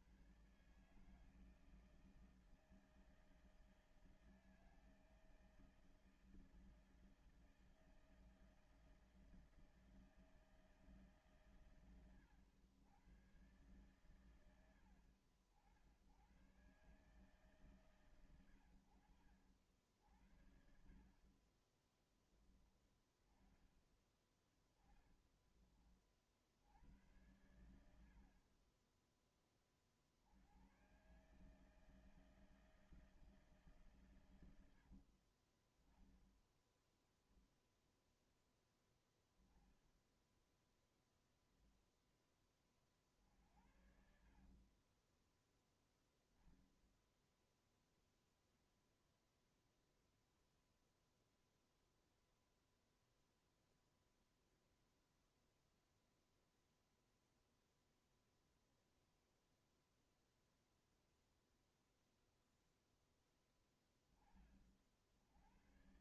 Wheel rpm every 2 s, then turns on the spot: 120, 160, 160, 160, 160, 160, 110, 110, 90, 100, 70, 20, 10, 60, 50, 80, 160, 100, 0, 0, 0, 10, 50, 10, 0, 0, 0, 0, 0, 0, 0, 0, 20.
20-22 24-26